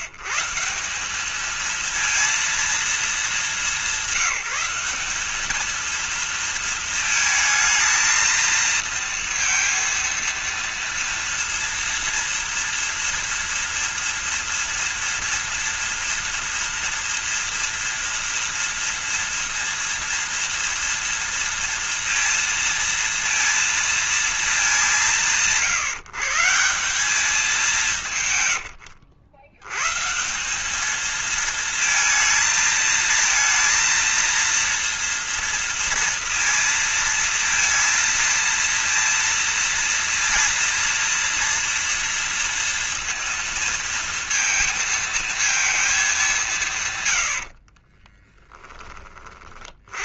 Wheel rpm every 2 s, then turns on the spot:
150, 230, 200, 230, 230, 230, 230, 230, 230, 230, 230, 230, 200, 160, 110, 190, 230, 230, 230, 230, 230, 230, 230, 190, 10.
48-50